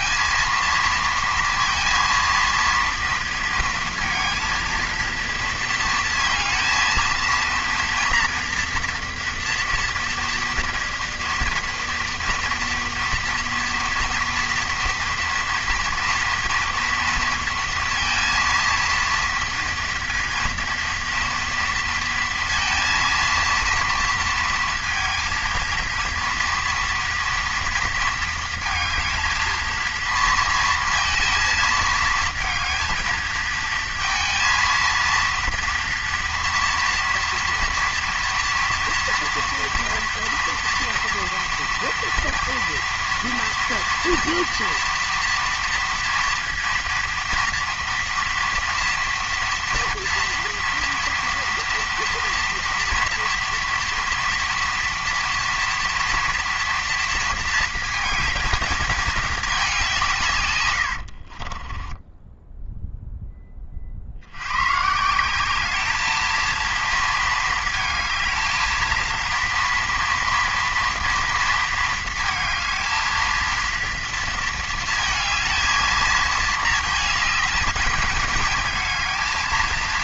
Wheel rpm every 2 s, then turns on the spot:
230, 230, 230, 230, 230, 230, 230, 230, 230, 230, 230, 230, 230, 230, 220, 230, 220, 230, 230, 230, 230, 230, 230, 230, 230, 230, 230, 230, 230, 220, 90, 0, 150, 230, 230, 230, 220, 220, 220, 220.
60-62